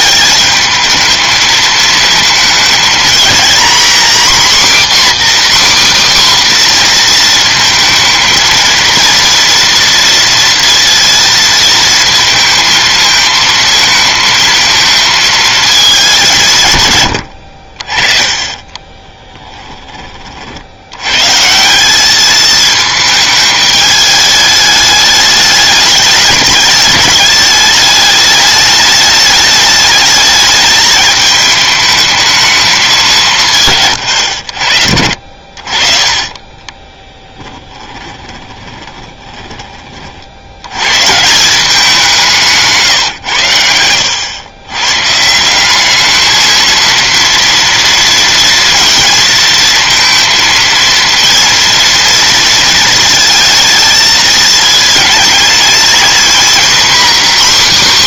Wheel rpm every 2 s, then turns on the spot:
200, 220, 260, 270, 230, 230, 220, 220, 160, 30, 50, 220, 210, 210, 210, 210, 220, 90, 20, 20, 80, 170, 110, 220, 230, 230, 230, 220, 250.
18-20 38-40